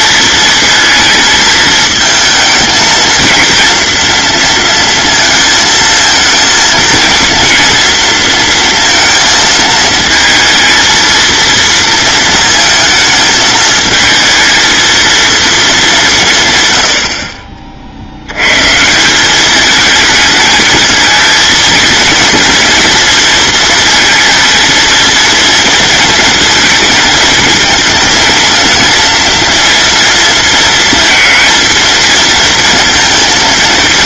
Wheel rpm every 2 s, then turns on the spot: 220, 220, 230, 230, 230, 230, 220, 220, 110, 160, 220, 230, 230, 230, 230, 220, 230.
16-18